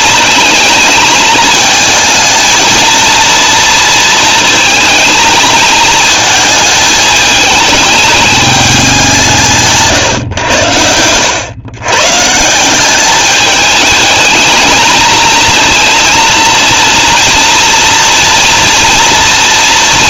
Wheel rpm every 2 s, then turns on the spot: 220, 230, 230, 220, 200, 100, 180, 220, 230, 230.
none